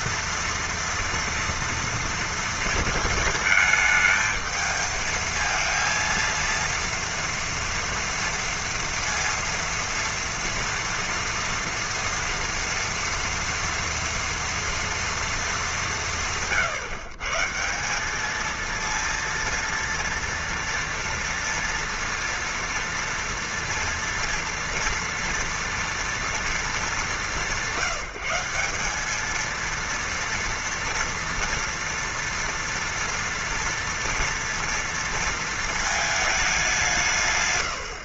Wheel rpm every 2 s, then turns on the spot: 230, 230, 220, 230, 230, 230, 230, 230, 150, 220, 240, 230, 230, 240, 180, 230, 230, 230, 210.
none